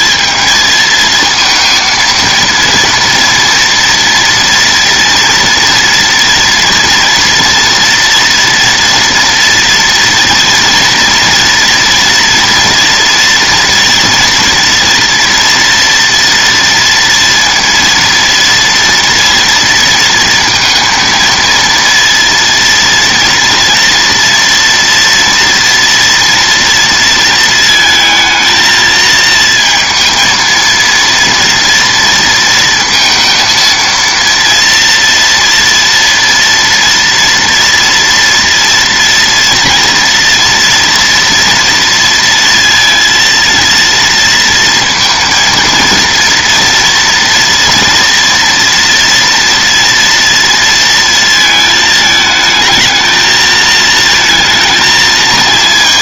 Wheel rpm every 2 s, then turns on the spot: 220, 230, 230, 240, 230, 230, 230, 230, 230, 230, 230, 230, 230, 230, 220, 230, 230, 230, 230, 240, 230, 230, 230, 230, 230, 230, 220, 230.
none